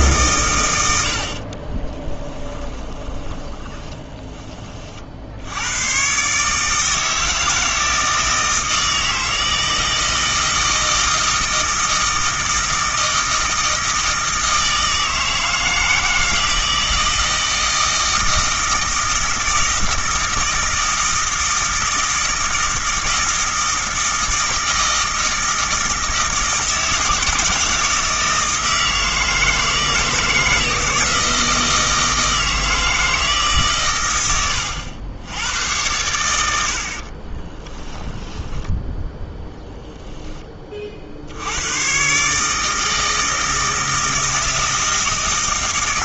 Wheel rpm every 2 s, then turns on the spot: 100, 20, 30, 150, 160, 160, 160, 160, 160, 160, 160, 160, 160, 160, 160, 160, 160, 90, 70, 10, 30, 160, 160.
2-4 36-40